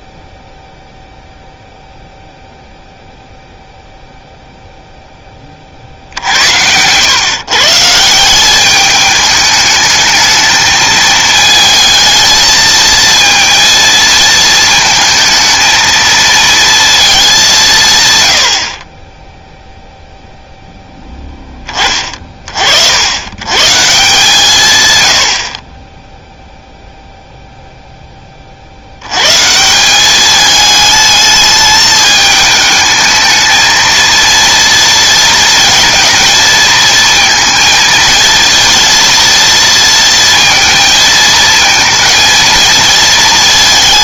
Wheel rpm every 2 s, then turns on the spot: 0, 0, 0, 90, 190, 220, 220, 220, 230, 60, 0, 50, 140, 0, 50, 210, 220, 230, 230, 230, 230, 230.
none